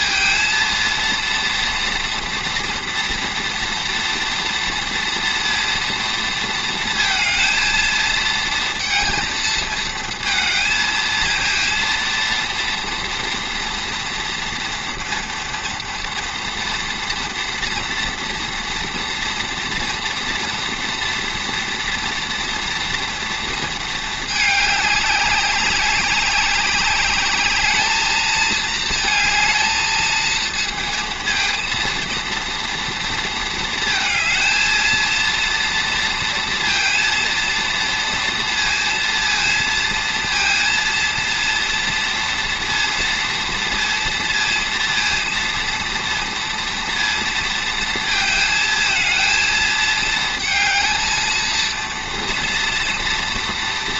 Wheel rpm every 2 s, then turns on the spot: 230, 230, 230, 230, 230, 230, 230, 230, 230, 230, 230, 240, 210, 200, 220, 230, 230, 220, 230, 230, 230, 230, 230, 230, 220, 220, 230.
none